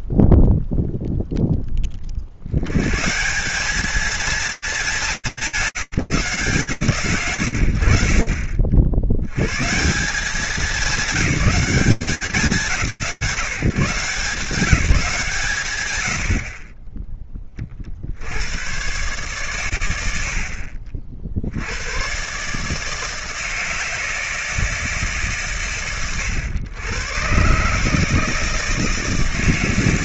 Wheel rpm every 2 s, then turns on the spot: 0, 120, 200, 150, 60, 210, 170, 160, 40, 80, 80, 150, 160, 110, 160.
none